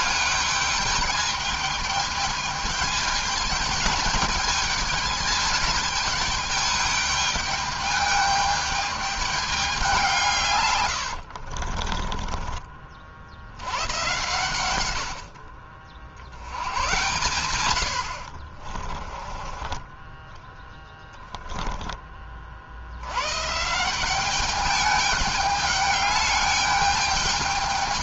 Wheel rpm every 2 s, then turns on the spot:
210, 210, 220, 210, 210, 160, 40, 120, 90, 40, 20, 40, 200, 210.
10-12 18-20